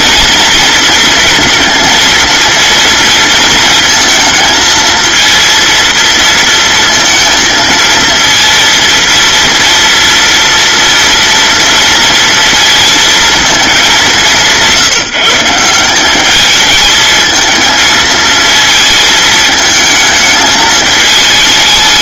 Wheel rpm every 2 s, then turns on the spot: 230, 230, 230, 230, 230, 230, 230, 170, 210, 220, 220.
none